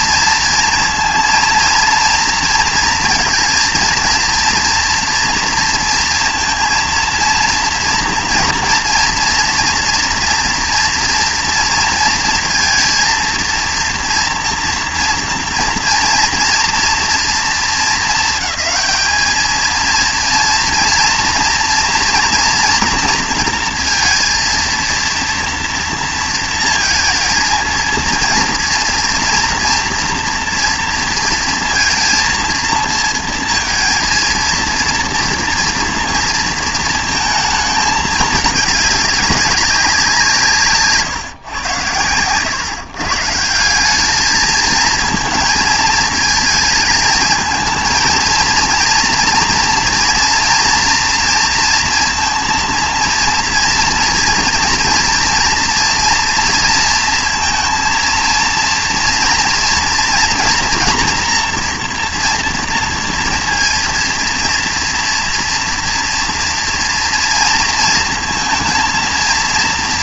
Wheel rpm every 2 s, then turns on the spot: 230, 230, 230, 230, 230, 230, 230, 230, 230, 220, 230, 230, 230, 230, 230, 230, 230, 230, 230, 210, 150, 130, 220, 220, 230, 230, 230, 230, 230, 230, 240, 230, 230, 230, 230.
none